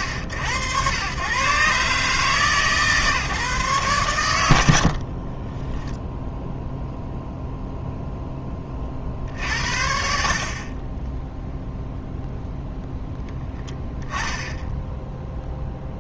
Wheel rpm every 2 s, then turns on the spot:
100, 150, 70, 0, 30, 50, 0, 10.
4-6